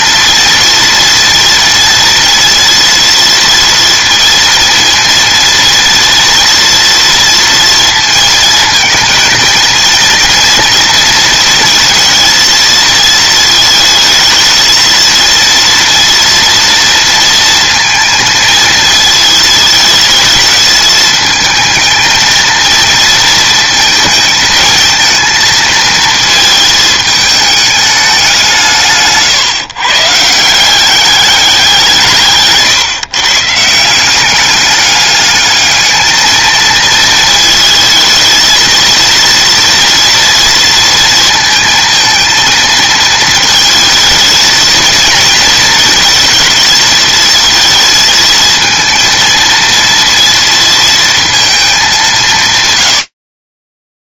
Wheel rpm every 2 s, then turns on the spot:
230, 230, 230, 240, 230, 230, 230, 220, 230, 220, 220, 230, 220, 220, 150, 190, 140, 200, 230, 230, 230, 220, 230, 220, 230, 230, 100.
none